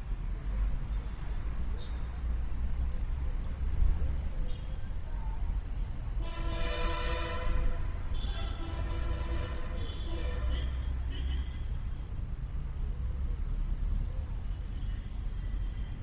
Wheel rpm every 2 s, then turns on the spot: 0, 0, 0, 0, 0, 0, 0, 0.
none